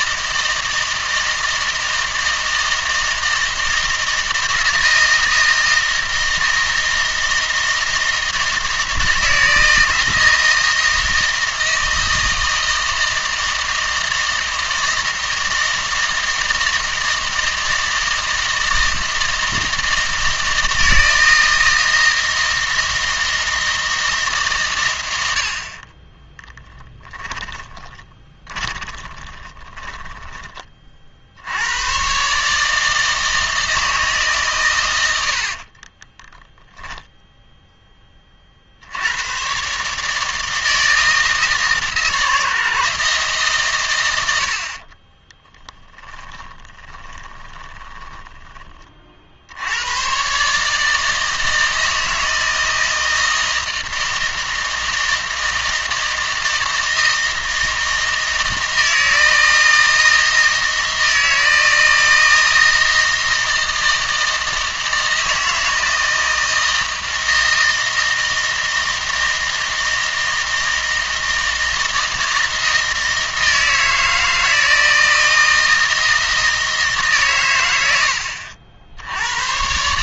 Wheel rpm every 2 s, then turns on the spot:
160, 160, 160, 160, 160, 160, 160, 160, 160, 160, 160, 160, 120, 10, 20, 30, 150, 110, 0, 70, 160, 160, 50, 20, 30, 150, 160, 160, 160, 160, 160, 160, 160, 160, 160, 160, 160, 160, 150, 60.
26-30 44-48